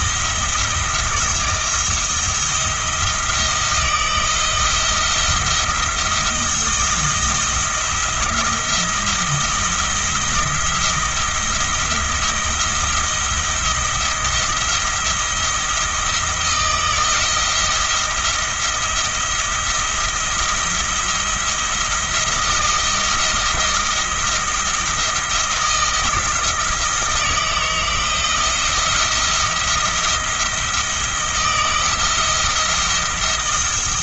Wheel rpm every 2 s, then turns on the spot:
170, 170, 170, 170, 170, 170, 170, 160, 160, 170, 170, 170, 170, 160, 170, 170, 170.
none